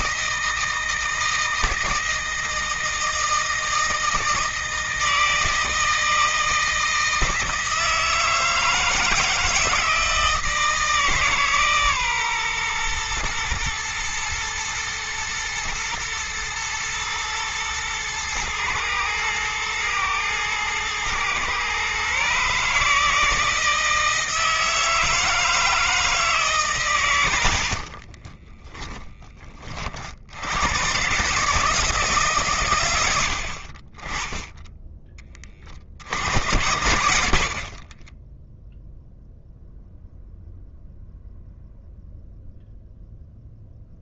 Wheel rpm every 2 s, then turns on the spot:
160, 160, 160, 160, 160, 160, 120, 110, 110, 110, 110, 150, 160, 140, 20, 110, 110, 10, 70, 0, 0, 0.
28-30